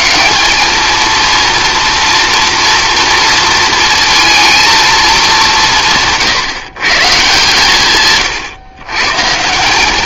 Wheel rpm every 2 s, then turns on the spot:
220, 240, 230, 140, 120.
none